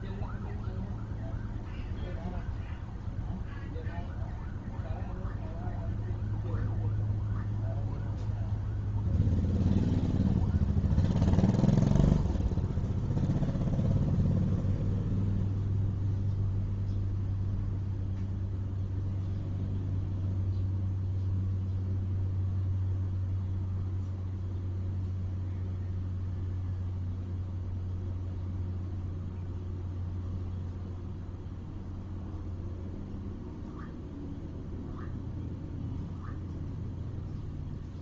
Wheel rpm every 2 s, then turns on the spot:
0, 0, 0, 0, 0, 0, 0, 0, 0, 0, 0, 0, 0, 0, 0, 0, 0, 0, 0.
none